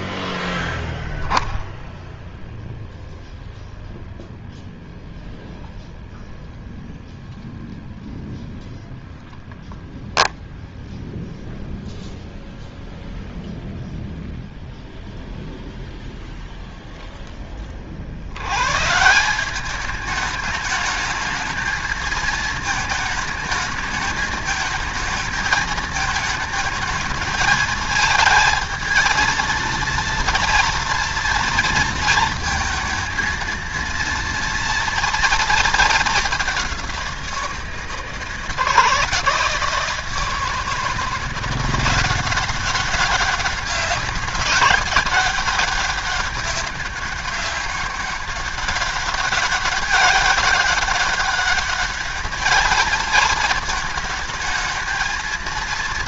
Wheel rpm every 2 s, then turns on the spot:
0, 0, 0, 0, 0, 0, 0, 0, 0, 160, 220, 220, 220, 220, 230, 230, 230, 230, 180, 160, 170, 200, 200, 200, 200, 200, 230, 220.
none